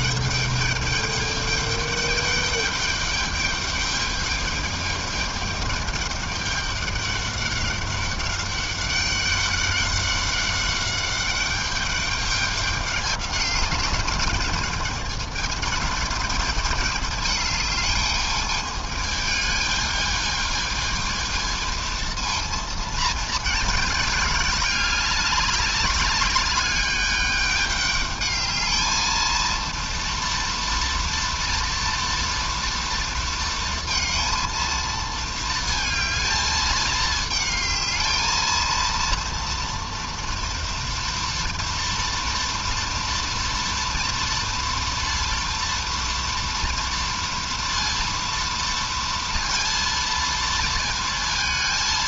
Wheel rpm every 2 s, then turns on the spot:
210, 210, 210, 200, 200, 200, 200, 210, 210, 220, 220, 220, 200, 210, 230, 230, 230, 220, 220, 230, 230, 230, 230, 230, 230, 230.
none